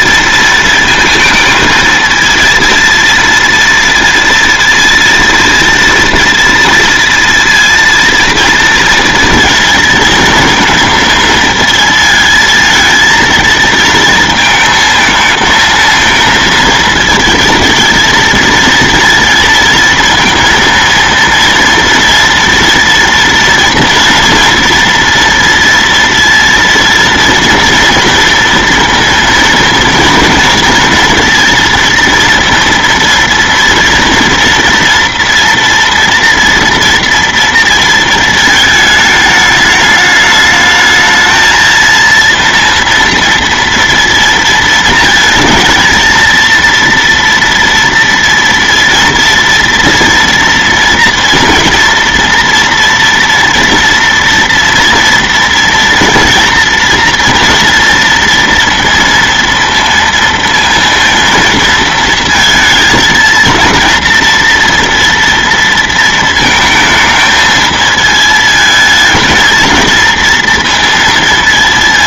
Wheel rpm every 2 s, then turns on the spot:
230, 230, 230, 230, 230, 230, 220, 220, 220, 230, 230, 230, 230, 230, 230, 230, 230, 230, 230, 220, 210, 230, 230, 230, 230, 230, 230, 230, 230, 230, 230, 220, 230, 220, 220, 230.
none